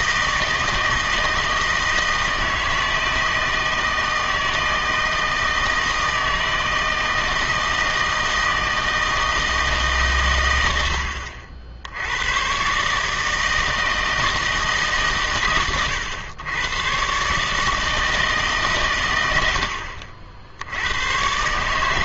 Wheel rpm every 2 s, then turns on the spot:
160, 160, 160, 160, 160, 90, 130, 150, 110, 130, 80.
none